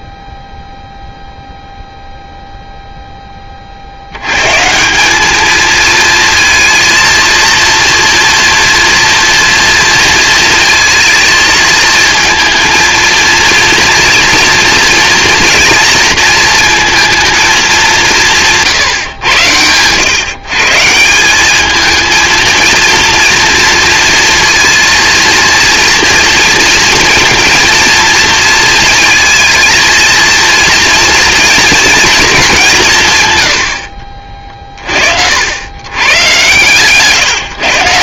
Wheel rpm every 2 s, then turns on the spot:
0, 0, 190, 230, 230, 230, 230, 230, 230, 140, 170, 230, 230, 220, 220, 230, 160, 60, 140.
none